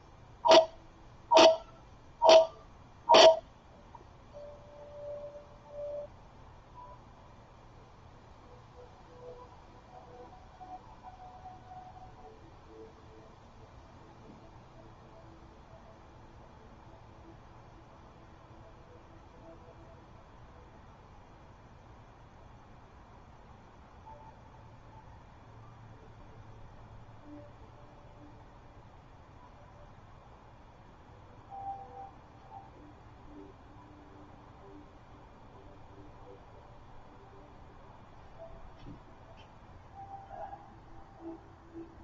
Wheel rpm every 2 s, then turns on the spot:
0, 0, 0, 0, 0, 0, 0, 0, 0, 0, 0, 0, 0, 0, 0, 0, 0, 0, 0, 0, 0.
none